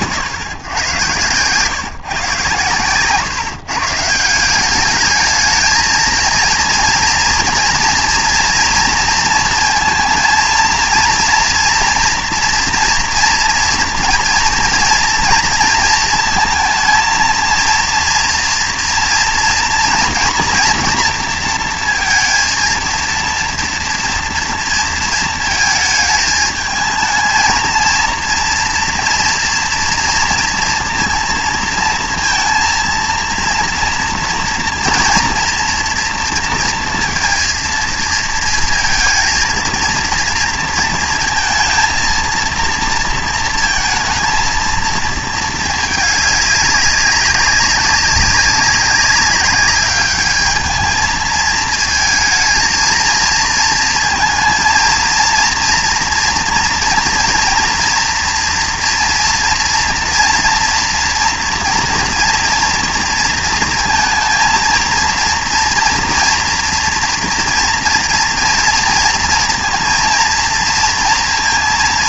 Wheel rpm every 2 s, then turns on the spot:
110, 130, 200, 230, 230, 230, 230, 230, 220, 230, 240, 230, 230, 220, 230, 230, 230, 230, 230, 230, 230, 230, 230, 200, 200, 220, 220, 230, 230, 230, 240, 230, 230, 230, 230, 230.
none